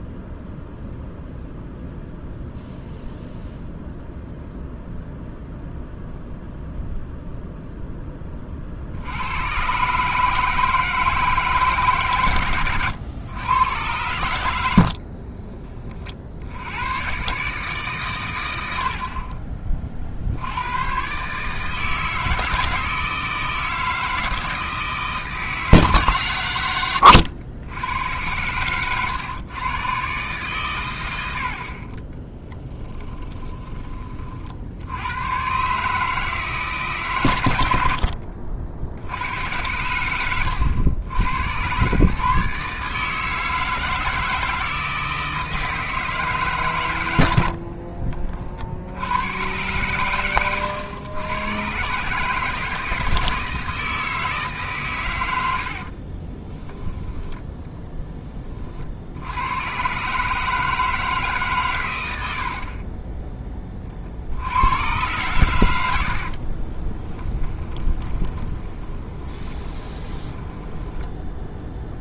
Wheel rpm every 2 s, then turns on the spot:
0, 0, 0, 0, 50, 150, 110, 50, 120, 70, 120, 160, 160, 110, 120, 100, 10, 80, 140, 70, 110, 150, 160, 110, 70, 100, 160, 130, 10, 60, 150, 30, 100, 20, 20, 10.
14-16 32-34 56-58 62-64 66-72